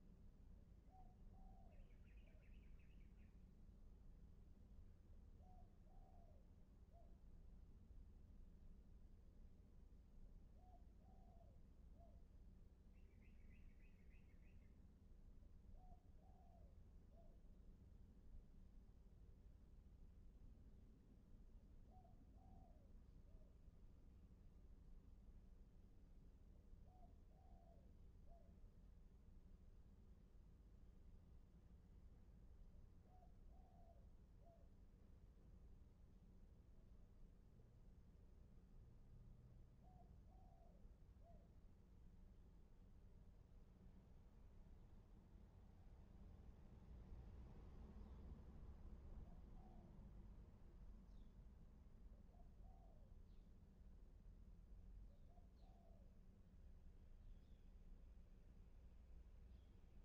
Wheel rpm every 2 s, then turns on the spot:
0, 0, 0, 0, 0, 0, 0, 0, 0, 0, 0, 0, 0, 0, 0, 0, 0, 0, 0, 0, 0, 0, 0, 0, 0, 0, 0, 0, 0, 0.
none